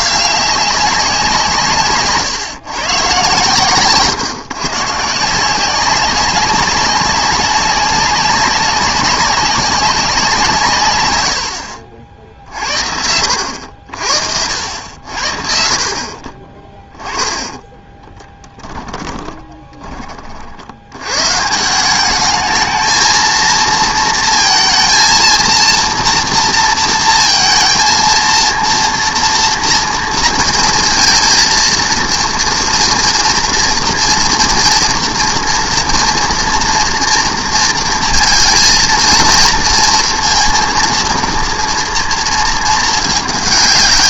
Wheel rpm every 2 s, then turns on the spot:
190, 130, 150, 200, 200, 130, 60, 80, 10, 10, 70, 220, 230, 230, 230, 230, 230, 230, 230, 230, 230, 220.
18-20